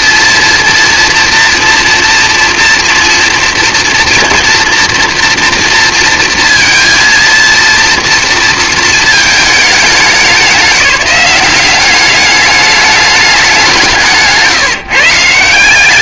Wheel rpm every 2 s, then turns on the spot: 230, 230, 230, 230, 230, 200, 200, 160.
none